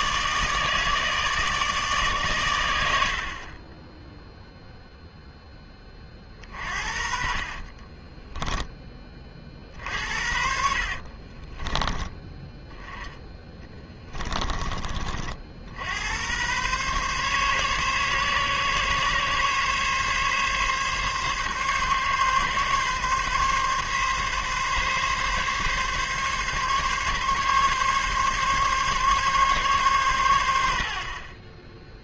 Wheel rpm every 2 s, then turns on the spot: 150, 70, 10, 30, 60, 20, 20, 100, 140, 140, 140, 140, 140, 140, 120, 0.
6-8 12-14